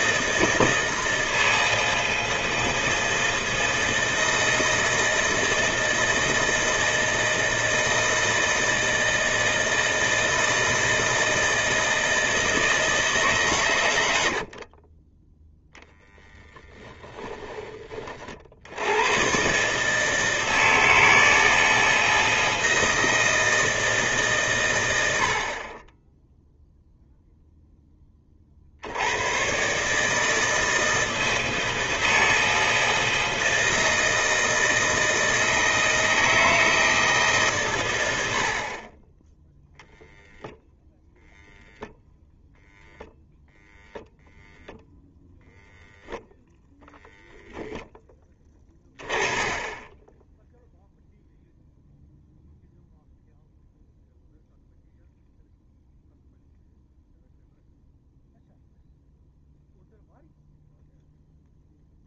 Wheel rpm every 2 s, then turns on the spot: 160, 160, 160, 160, 160, 160, 160, 60, 10, 70, 160, 160, 140, 0, 50, 160, 160, 160, 160, 50, 0, 0, 0, 0, 10, 0, 0, 0, 0, 0, 0.
14-16